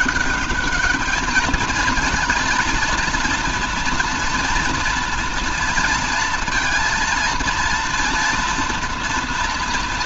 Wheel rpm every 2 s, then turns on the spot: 200, 220, 230, 230, 240.
none